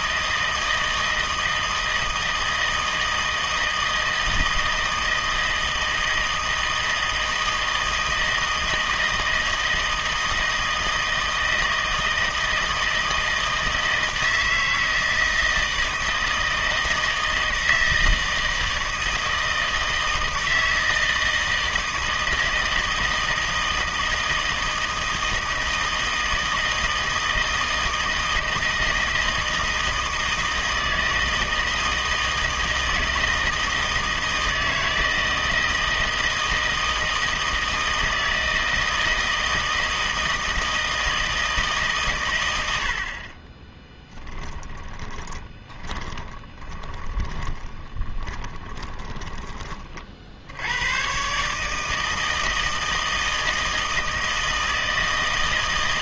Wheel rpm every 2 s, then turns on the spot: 160, 160, 160, 160, 160, 160, 160, 160, 160, 160, 160, 160, 160, 160, 160, 160, 160, 160, 160, 160, 160, 100, 10, 20, 10, 80, 160, 160.
44-50